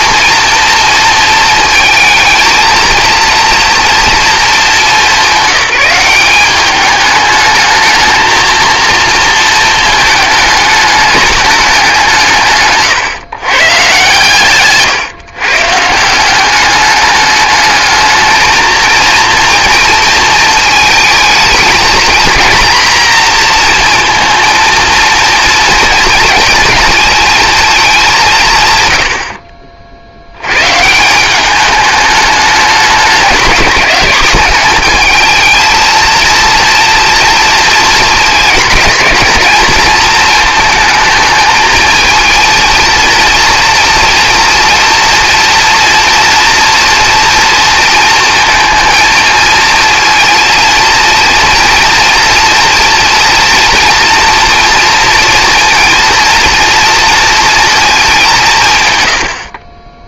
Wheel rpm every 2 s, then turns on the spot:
230, 230, 220, 200, 220, 210, 150, 140, 190, 220, 230, 230, 230, 230, 130, 120, 210, 210, 230, 220, 220, 230, 230, 230, 230, 230, 230, 230, 230, 160.
none